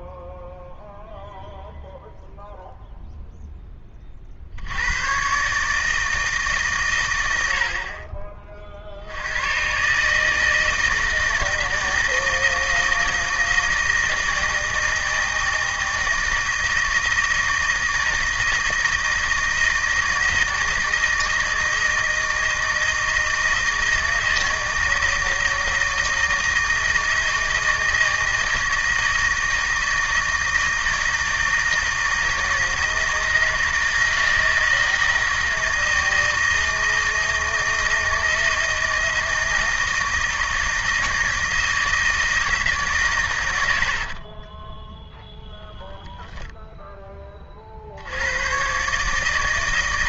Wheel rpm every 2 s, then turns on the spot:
0, 0, 80, 140, 50, 160, 160, 160, 160, 160, 160, 160, 160, 160, 160, 160, 160, 160, 160, 160, 160, 150, 20, 0, 120.
44-46